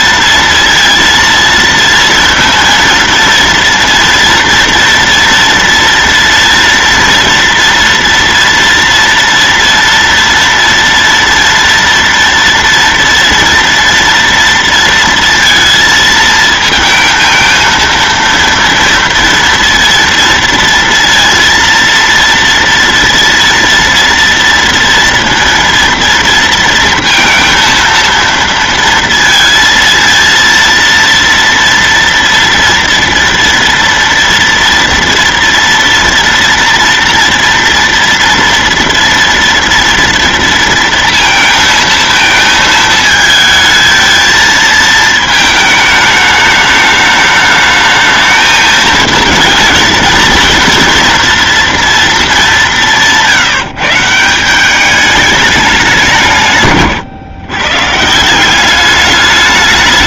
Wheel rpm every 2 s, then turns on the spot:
230, 230, 230, 230, 240, 230, 230, 230, 230, 230, 230, 230, 230, 230, 230, 230, 230, 230, 230, 230, 230, 220, 220, 210, 220, 230, 180, 200, 130, 200.
none